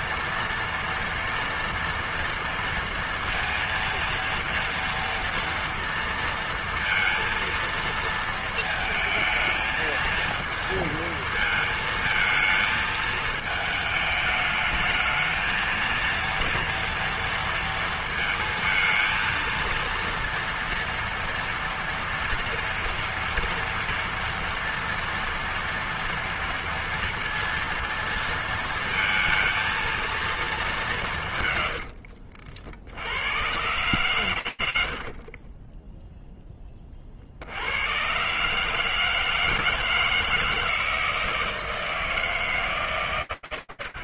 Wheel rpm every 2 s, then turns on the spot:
230, 230, 230, 230, 220, 220, 220, 210, 230, 230, 230, 230, 230, 230, 230, 210, 60, 80, 20, 150, 160, 160.
none